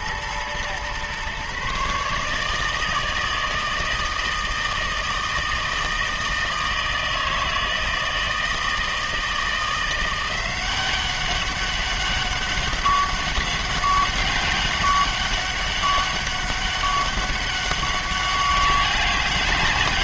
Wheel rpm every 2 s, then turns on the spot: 120, 160, 160, 160, 160, 180, 190, 200, 200, 200.
none